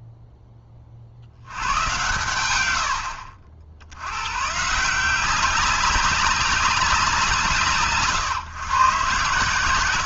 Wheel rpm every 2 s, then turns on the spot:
20, 80, 150, 200, 130.
none